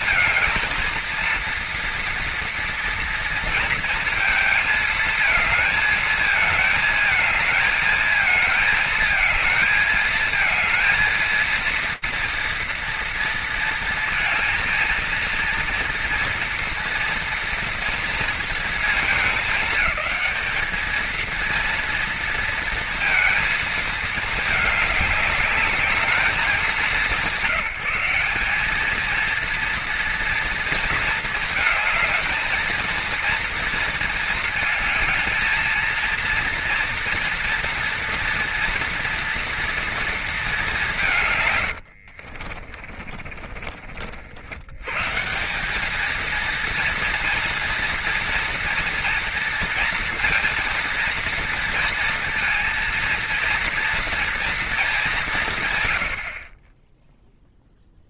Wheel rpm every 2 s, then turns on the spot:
230, 230, 220, 220, 220, 230, 230, 230, 230, 220, 230, 230, 210, 170, 220, 230, 230, 220, 230, 230, 170, 30, 120, 230, 230, 230, 230, 220, 30.
42-44